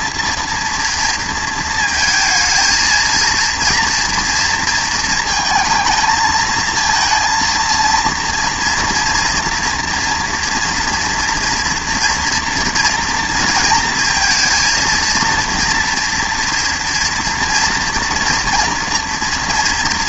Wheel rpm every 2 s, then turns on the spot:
230, 220, 230, 220, 230, 230, 230, 230, 230, 240.
none